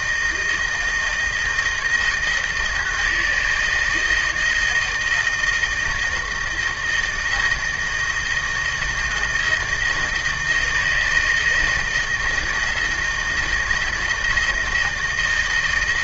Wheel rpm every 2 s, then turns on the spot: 160, 160, 160, 160, 160, 160, 160, 170.
none